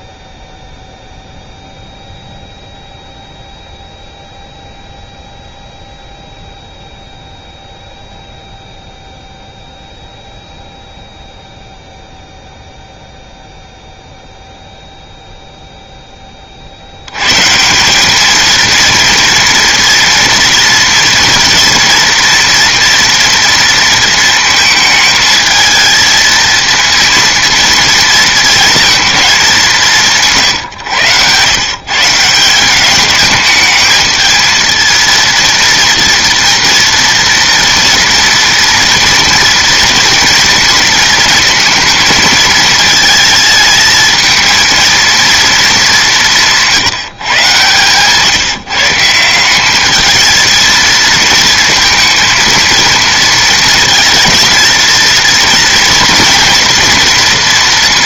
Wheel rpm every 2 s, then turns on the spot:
0, 0, 0, 0, 0, 0, 0, 0, 50, 230, 230, 240, 220, 230, 230, 130, 190, 230, 230, 240, 230, 220, 220, 170, 160, 220, 230, 230, 230.
none